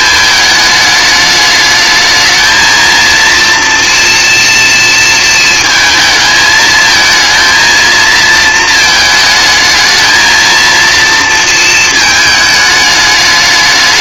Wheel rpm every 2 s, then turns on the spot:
220, 220, 230, 220, 220, 230, 210.
none